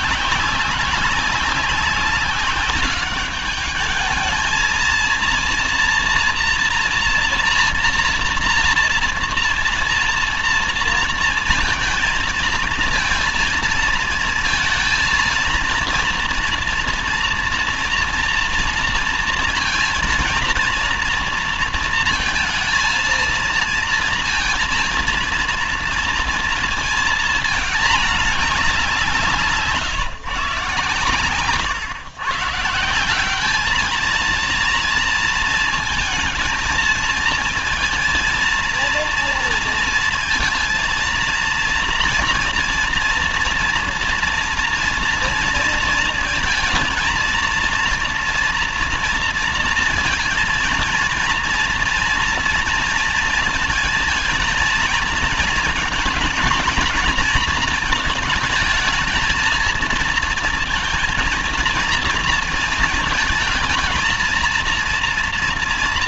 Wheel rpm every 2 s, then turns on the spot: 200, 200, 220, 230, 230, 230, 220, 230, 230, 230, 230, 230, 230, 230, 200, 150, 160, 230, 230, 230, 230, 230, 230, 230, 230, 230, 230, 220, 240, 210, 230, 230, 230.
none